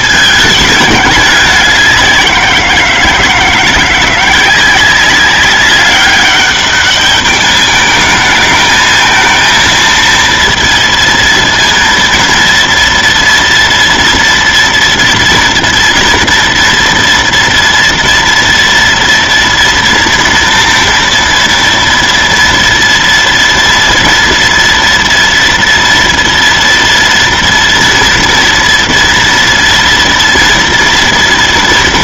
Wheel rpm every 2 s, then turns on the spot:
210, 180, 190, 200, 220, 230, 230, 230, 240, 230, 230, 230, 230, 230, 230, 230.
none